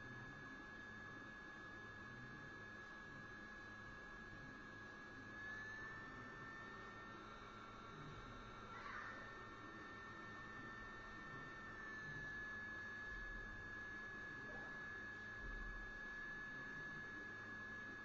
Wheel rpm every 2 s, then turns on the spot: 0, 0, 0, 0, 0, 0, 0, 0, 0.
none